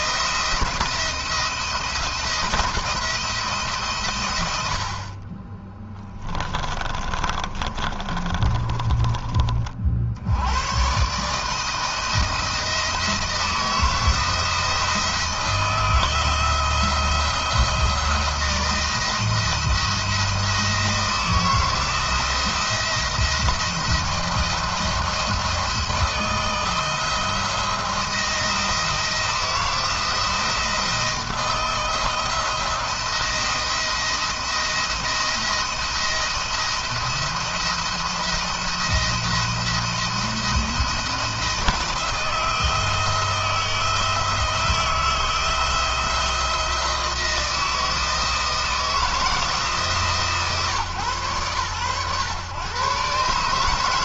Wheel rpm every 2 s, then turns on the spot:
170, 170, 90, 30, 30, 100, 170, 170, 170, 170, 160, 170, 170, 170, 170, 170, 170, 170, 170, 170, 170, 160, 160, 170, 160, 140, 120.
6-10